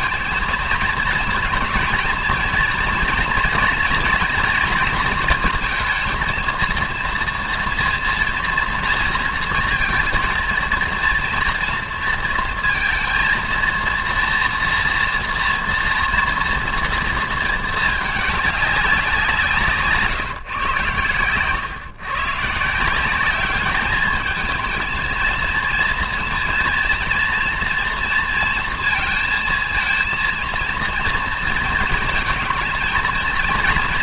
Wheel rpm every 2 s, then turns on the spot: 220, 230, 230, 230, 230, 230, 230, 230, 230, 210, 130, 140, 220, 230, 230, 230, 220.
none